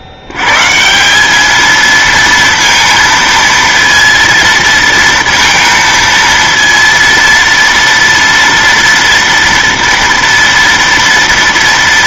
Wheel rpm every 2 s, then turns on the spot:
80, 230, 230, 230, 230, 230.
none